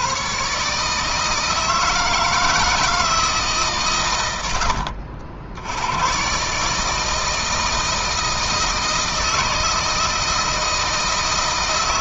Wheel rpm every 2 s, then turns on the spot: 140, 160, 90, 150, 160, 160.
none